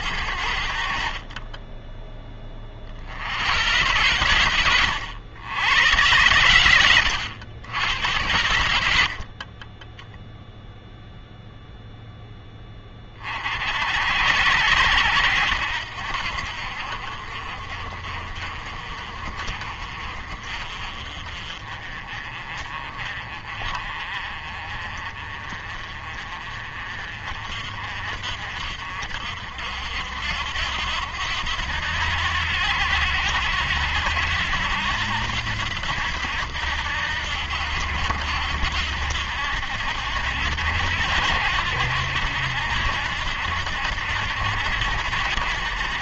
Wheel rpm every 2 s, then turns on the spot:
50, 50, 90, 100, 80, 0, 20, 80, 50, 50, 40, 40, 40, 40, 50, 80, 80, 80, 80, 80, 80, 80, 80.
none